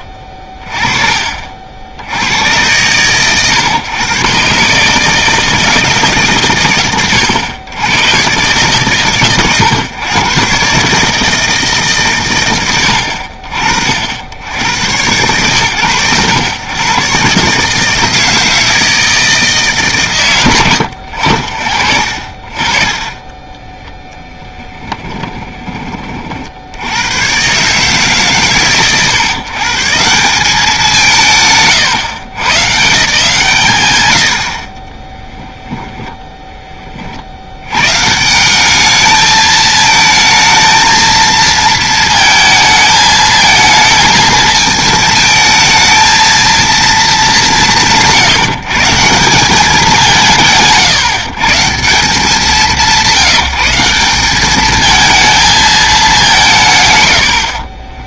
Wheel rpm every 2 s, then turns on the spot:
30, 100, 150, 90, 120, 140, 60, 100, 110, 160, 120, 20, 10, 100, 110, 180, 160, 30, 30, 200, 220, 220, 220, 210, 160, 120, 180, 210, 170.
24-26